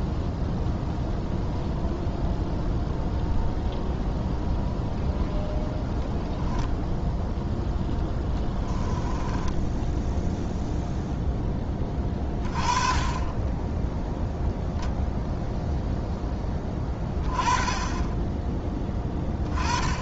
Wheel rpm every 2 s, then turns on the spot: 0, 0, 0, 0, 10, 0, 20, 0, 30, 10.
8-10